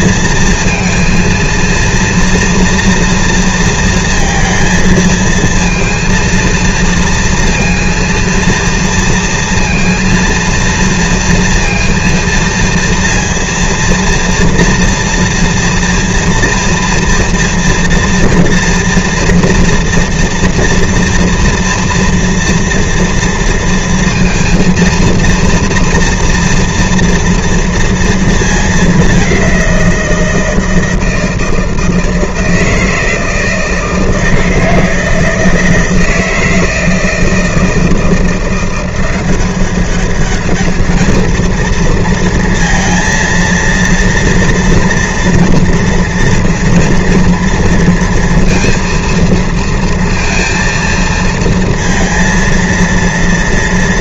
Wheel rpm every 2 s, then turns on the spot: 230, 230, 230, 230, 230, 230, 230, 230, 230, 230, 240, 230, 230, 230, 220, 160, 160, 160, 160, 170, 210, 230, 230, 230, 230, 230, 230.
none